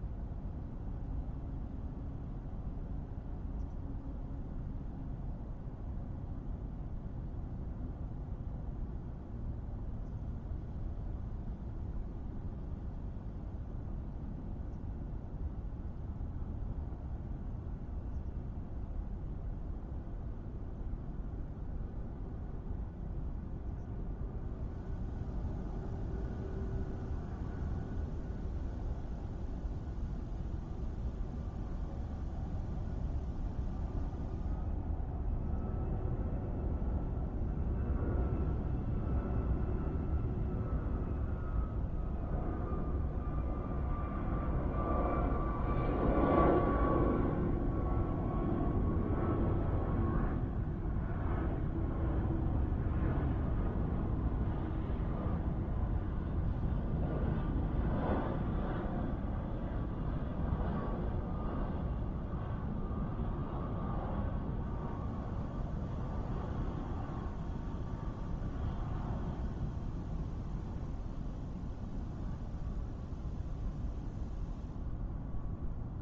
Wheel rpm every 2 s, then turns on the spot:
0, 0, 0, 0, 0, 0, 0, 0, 0, 0, 0, 0, 0, 0, 0, 0, 0, 0, 0, 0, 0, 0, 0, 0, 0, 0, 0, 0, 0, 0, 0, 0, 0, 0, 0, 0, 0, 0.
none